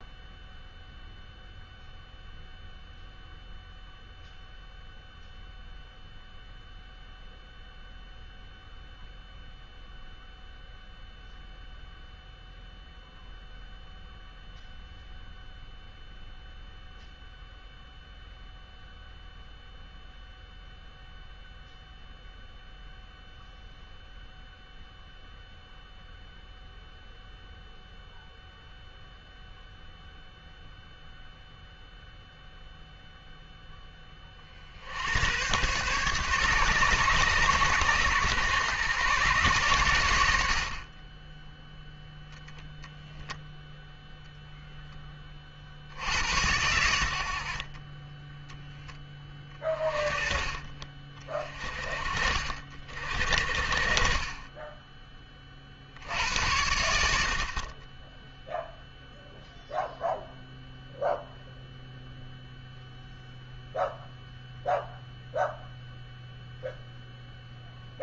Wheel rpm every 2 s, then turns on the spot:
0, 0, 0, 0, 0, 0, 0, 0, 0, 0, 0, 0, 0, 0, 0, 0, 0, 50, 140, 120, 60, 0, 0, 100, 10, 30, 50, 20, 80, 0, 0, 0, 0, 0.
none